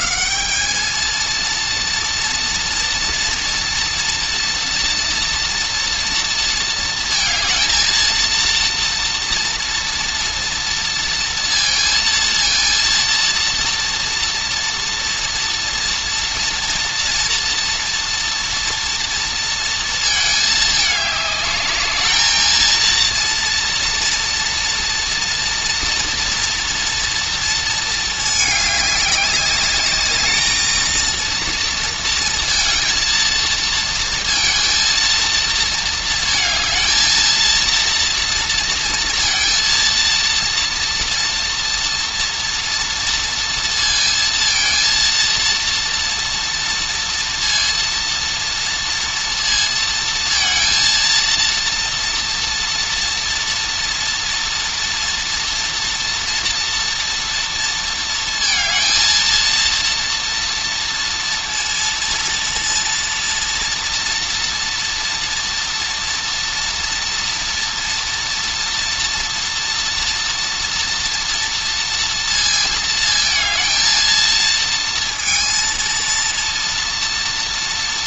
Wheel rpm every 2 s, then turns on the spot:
190, 230, 230, 230, 230, 230, 230, 230, 230, 240, 220, 220, 230, 230, 210, 220, 230, 230, 220, 230, 230, 230, 230, 230, 230, 230, 230, 230, 230, 230, 230, 230, 230, 230, 240, 230, 230, 230, 230.
none